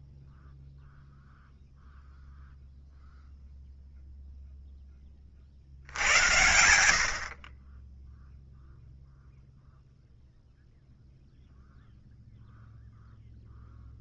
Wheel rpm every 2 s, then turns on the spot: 0, 0, 10, 80, 0, 0, 0.
none